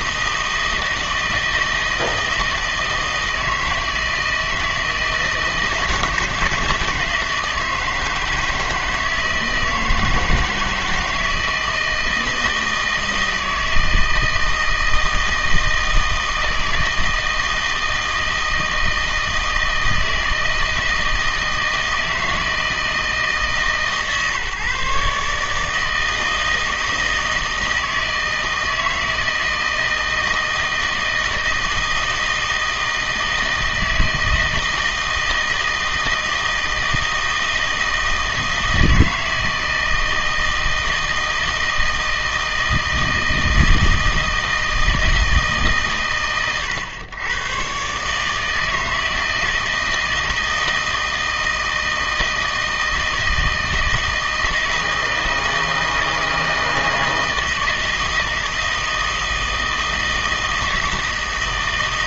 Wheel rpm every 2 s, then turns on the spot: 160, 160, 160, 160, 160, 160, 160, 160, 160, 160, 160, 160, 150, 160, 160, 160, 160, 160, 160, 160, 160, 160, 160, 110, 160, 160, 160, 160, 160, 160, 160.
none